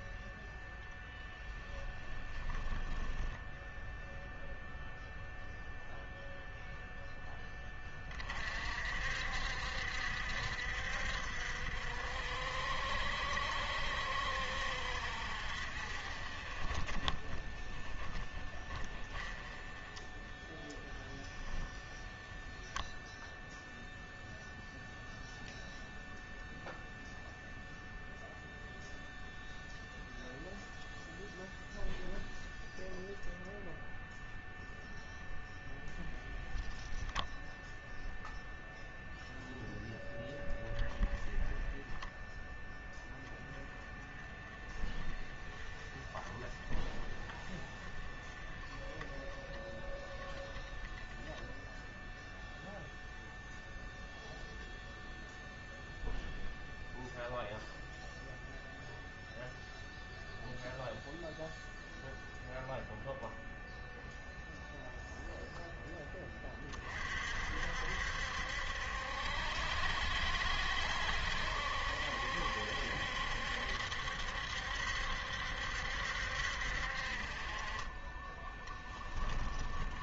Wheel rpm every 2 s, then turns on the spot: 0, 10, 0, 0, 50, 60, 60, 60, 20, 10, 0, 0, 0, 0, 0, 0, 0, 0, 0, 0, 10, 0, 20, 20, 10, 10, 0, 0, 0, 0, 0, 0, 0, 30, 70, 70, 70, 70, 50, 10.
2-4 78-80